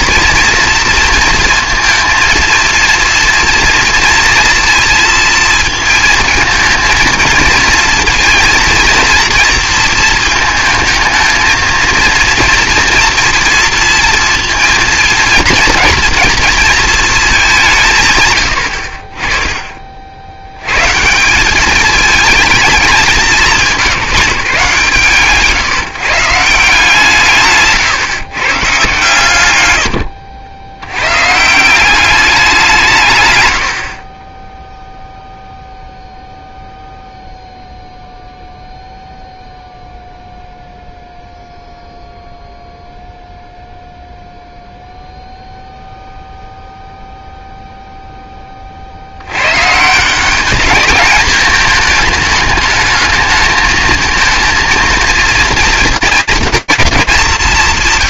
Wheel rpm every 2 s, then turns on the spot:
230, 230, 230, 230, 230, 220, 230, 230, 230, 90, 90, 220, 170, 170, 130, 90, 180, 10, 0, 0, 0, 0, 0, 0, 30, 210, 220, 230, 240.
none